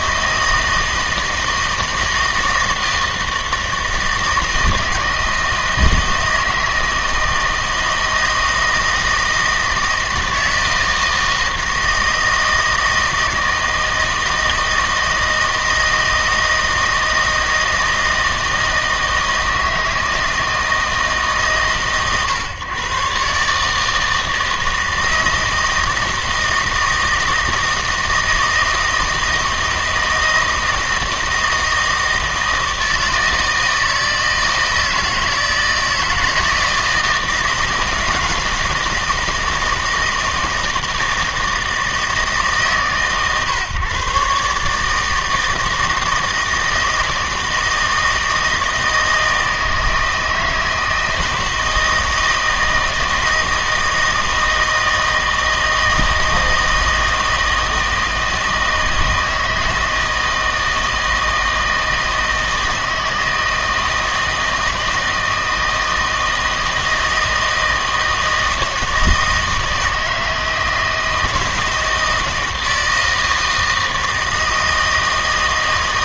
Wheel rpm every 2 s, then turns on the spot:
160, 160, 160, 160, 160, 160, 160, 160, 160, 160, 140, 140, 160, 160, 160, 160, 160, 160, 160, 160, 160, 140, 160, 160, 160, 160, 160, 160, 160, 160, 160, 160, 160, 160, 160, 160, 160, 160.
none